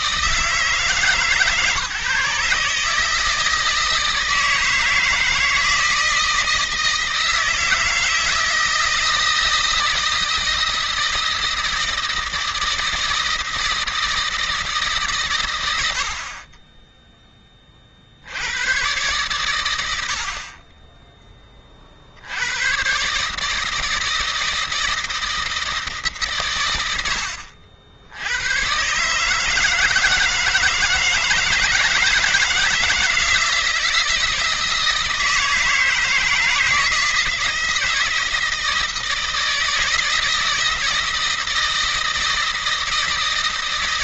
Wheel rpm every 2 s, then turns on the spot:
160, 150, 160, 160, 160, 160, 160, 150, 10, 110, 30, 110, 160, 120, 120, 160, 160, 160, 160, 160, 160, 160.
none